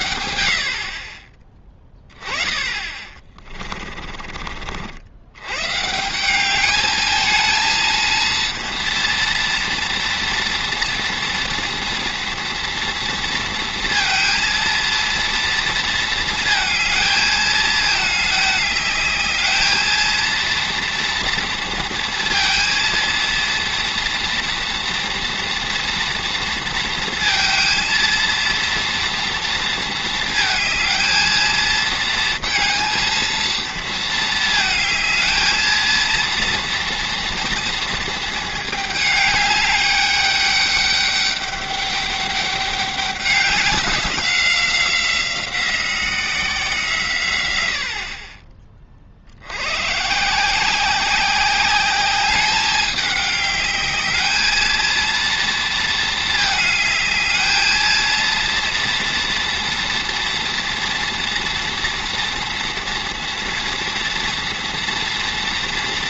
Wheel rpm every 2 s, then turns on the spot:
70, 30, 50, 200, 230, 230, 230, 230, 230, 210, 230, 230, 230, 230, 230, 220, 230, 220, 230, 220, 200, 200, 180, 170, 20, 160, 200, 220, 220, 230, 240, 230, 230.
4-6